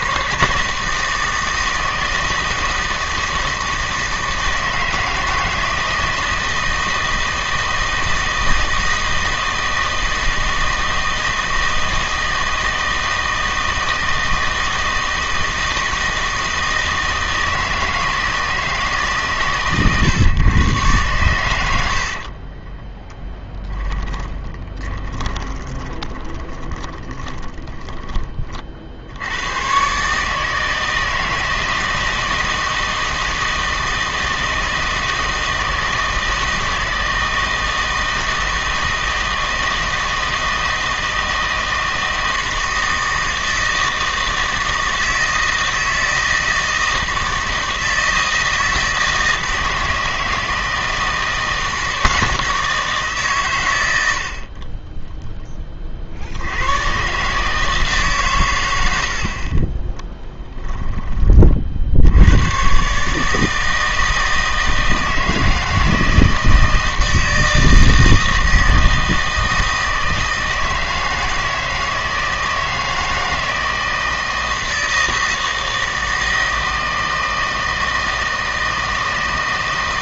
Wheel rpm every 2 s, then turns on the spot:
160, 160, 160, 160, 160, 160, 160, 160, 160, 160, 120, 30, 20, 20, 50, 160, 160, 160, 160, 160, 160, 160, 160, 160, 160, 160, 160, 30, 100, 90, 10, 120, 160, 160, 160, 160, 160, 160, 160, 160.
22-28 60-62